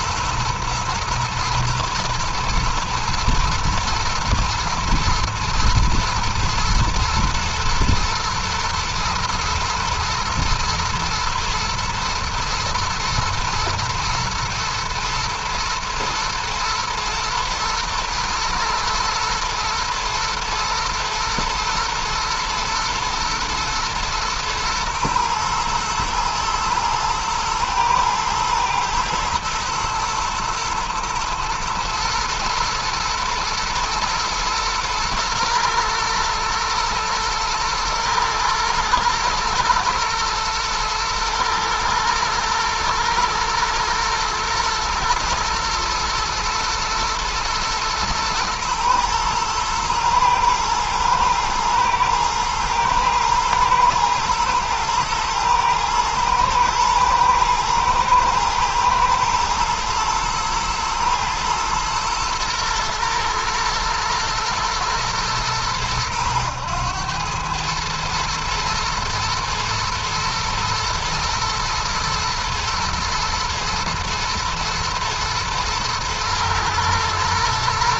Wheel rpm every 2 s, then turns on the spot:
110, 120, 120, 110, 110, 120, 120, 120, 110, 110, 110, 120, 120, 120, 110, 110, 110, 120, 120, 120, 120, 120, 110, 110, 120, 110, 120, 110, 110, 110, 110, 120, 110, 110, 120, 110, 120, 110, 110.
none